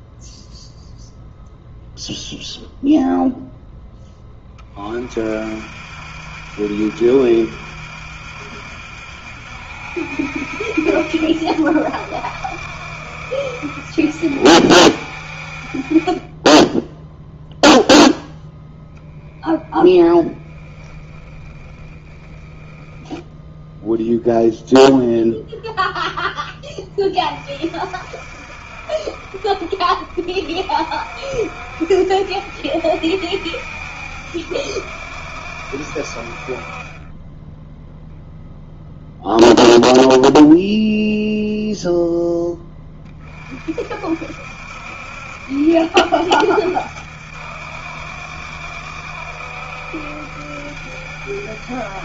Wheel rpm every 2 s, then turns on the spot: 0, 0, 30, 70, 70, 70, 70, 60, 10, 0, 10, 10, 0, 20, 50, 50, 70, 70, 20, 0, 0, 20, 70, 70, 70, 70.
20-24